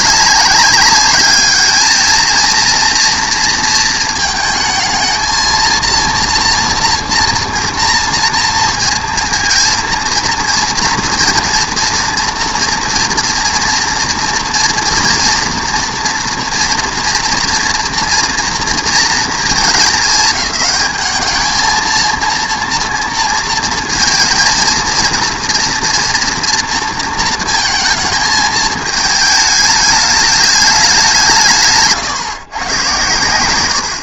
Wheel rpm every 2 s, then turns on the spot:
200, 230, 220, 230, 230, 230, 230, 230, 230, 230, 210, 230, 230, 230, 220, 210, 130.
none